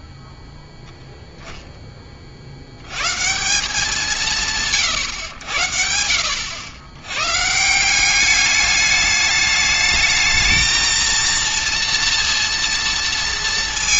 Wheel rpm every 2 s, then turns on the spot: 0, 80, 140, 100, 210, 220, 230.
none